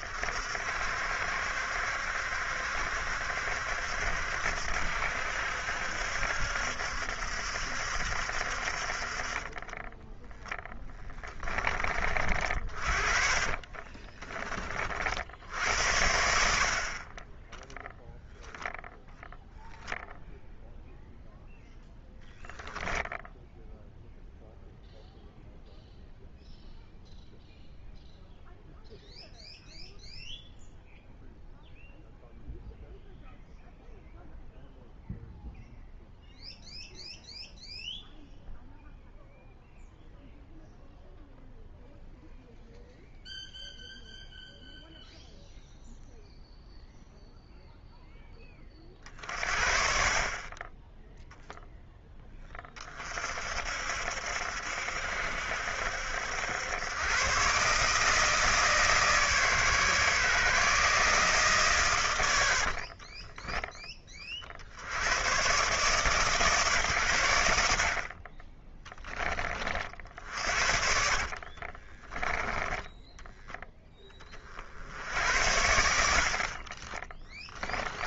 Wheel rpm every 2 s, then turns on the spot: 60, 70, 70, 70, 60, 10, 40, 30, 70, 0, 0, 0, 0, 0, 0, 0, 0, 0, 0, 0, 0, 0, 0, 0, 20, 30, 10, 70, 80, 160, 150, 100, 40, 150, 30, 50, 10, 30, 60.
10-12 14-16 62-64 70-74